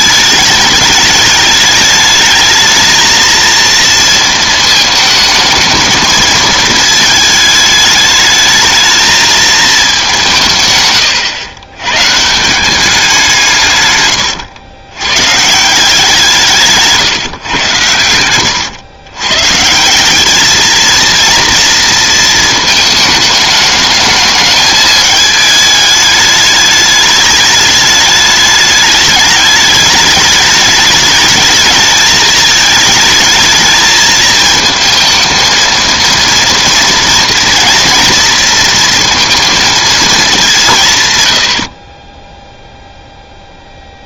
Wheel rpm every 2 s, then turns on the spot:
210, 220, 220, 220, 220, 120, 180, 110, 150, 110, 230, 220, 210, 210, 210, 210, 220, 220, 230, 230, 150, 0.
10-12